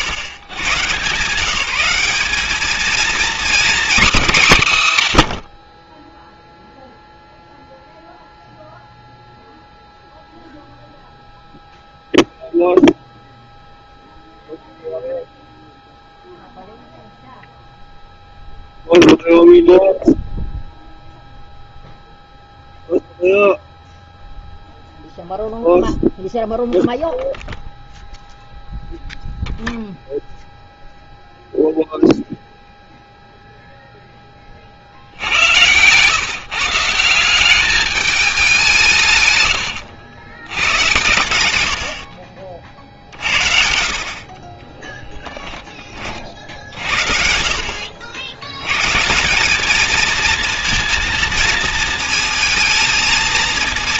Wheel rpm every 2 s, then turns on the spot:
140, 210, 190, 0, 0, 0, 0, 0, 0, 0, 0, 0, 0, 0, 0, 0, 0, 30, 150, 190, 120, 60, 30, 50, 80, 230, 230.
none